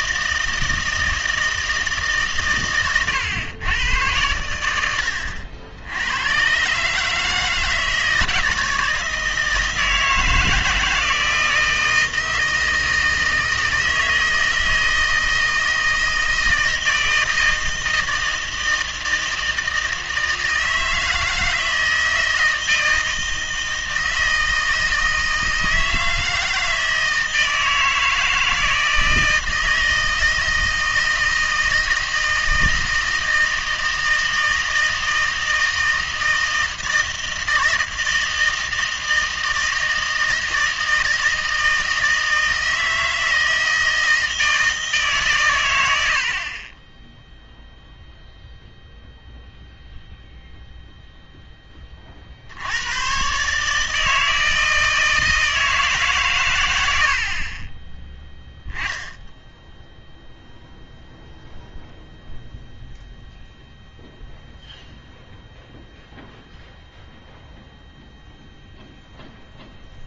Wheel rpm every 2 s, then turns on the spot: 160, 110, 90, 130, 160, 160, 160, 160, 160, 160, 160, 160, 160, 160, 160, 160, 160, 160, 160, 160, 160, 160, 160, 20, 0, 0, 80, 160, 100, 0, 0, 0, 0, 0, 0.
none